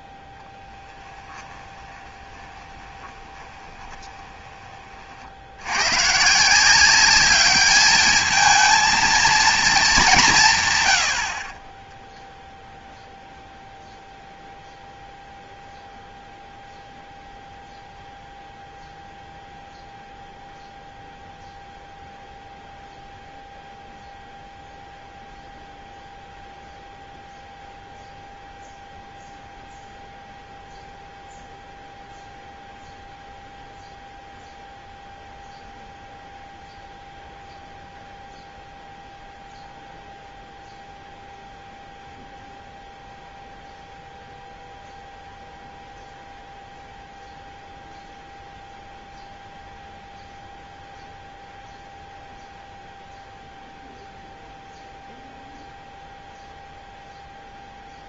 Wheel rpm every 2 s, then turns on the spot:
10, 20, 20, 160, 220, 130, 0, 0, 0, 0, 0, 0, 0, 0, 0, 0, 0, 0, 0, 0, 0, 0, 0, 0, 0, 0, 0, 0, 0.
2-4